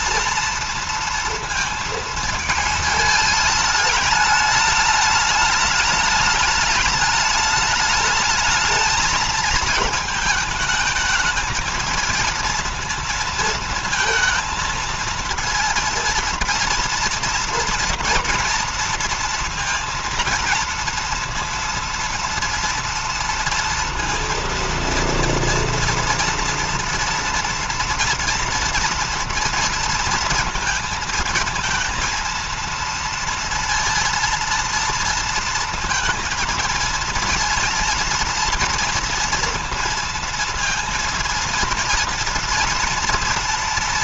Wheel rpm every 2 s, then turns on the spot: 230, 220, 210, 210, 220, 220, 230, 230, 230, 230, 230, 230, 230, 230, 230, 230, 230, 230, 230, 230, 230, 230.
none